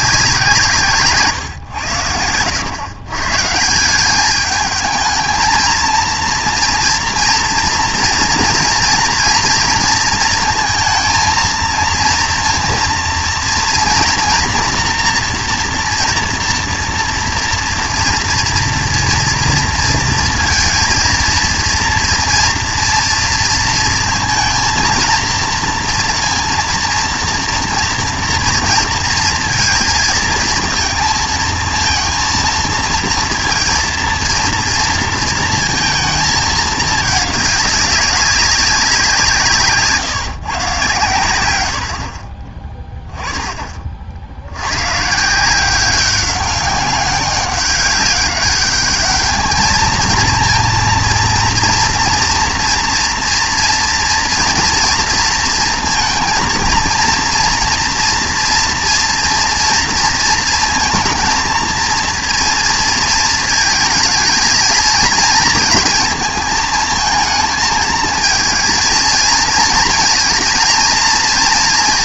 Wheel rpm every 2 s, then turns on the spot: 160, 100, 220, 230, 240, 230, 230, 240, 230, 230, 230, 230, 220, 230, 230, 230, 230, 230, 220, 200, 130, 20, 90, 200, 200, 230, 230, 230, 230, 230, 230, 230, 230, 220, 220, 230.
none